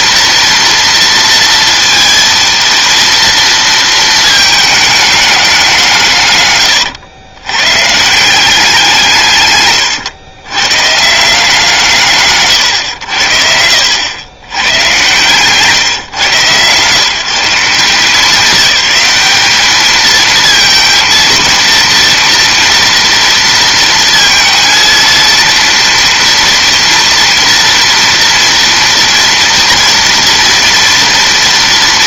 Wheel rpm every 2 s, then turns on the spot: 230, 230, 220, 130, 190, 120, 130, 100, 130, 200, 220, 230, 230, 230, 230, 230.
none